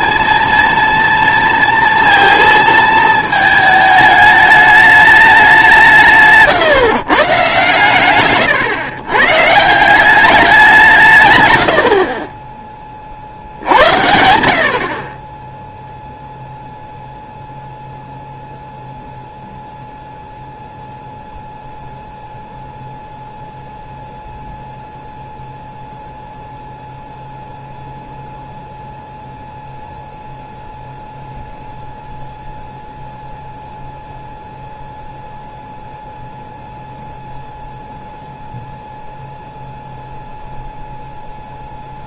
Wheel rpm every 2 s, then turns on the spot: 230, 220, 210, 140, 120, 180, 30, 50, 0, 0, 0, 0, 0, 0, 0, 0, 0, 0, 0, 0, 0.
none